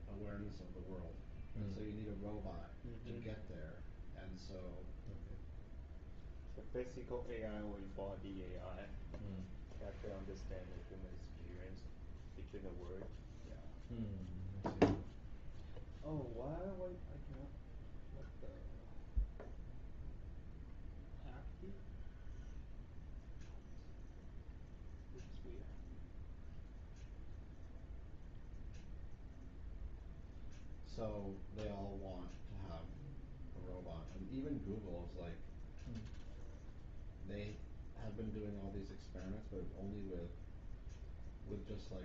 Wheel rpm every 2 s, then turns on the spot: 0, 0, 0, 0, 0, 0, 0, 0, 0, 0, 0, 0, 0, 0, 0, 0, 0, 0, 0, 0, 0.
none